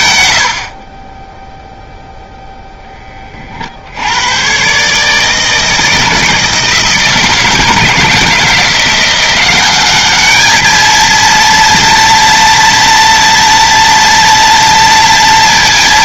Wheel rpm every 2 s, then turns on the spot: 10, 20, 150, 160, 170, 230, 230, 230.
none